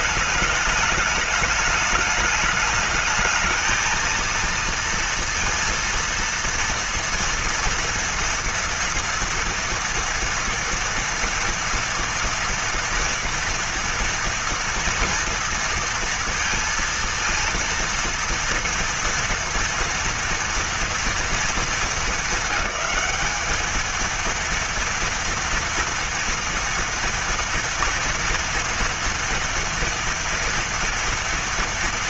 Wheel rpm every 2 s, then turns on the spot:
210, 210, 230, 230, 230, 230, 230, 230, 230, 230, 230, 200, 230, 230, 230, 230.
none